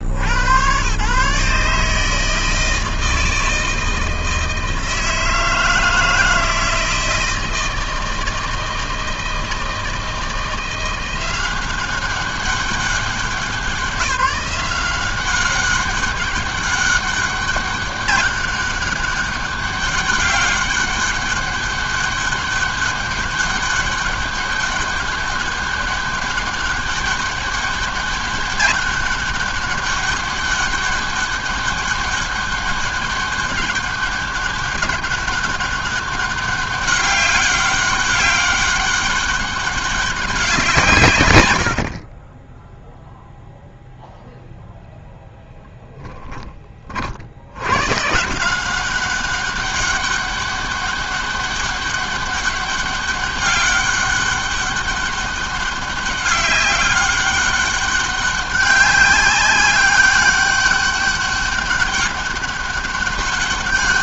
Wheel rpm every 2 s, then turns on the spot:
120, 160, 160, 160, 160, 180, 190, 190, 200, 200, 200, 200, 200, 200, 200, 200, 200, 200, 200, 200, 140, 0, 0, 40, 190, 200, 200, 200, 200, 190, 200, 200.
none